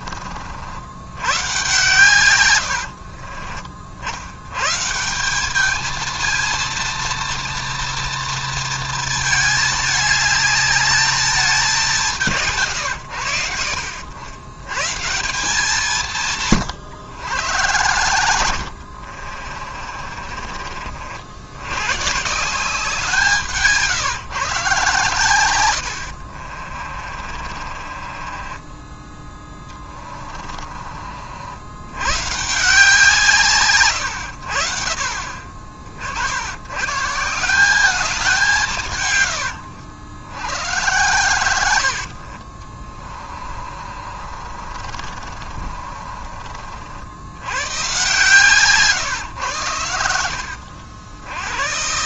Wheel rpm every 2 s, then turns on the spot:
70, 80, 120, 230, 230, 210, 150, 110, 140, 80, 40, 180, 140, 50, 20, 40, 160, 70, 120, 160, 90, 40, 50, 50, 140, 70.
2-4 26-32 42-46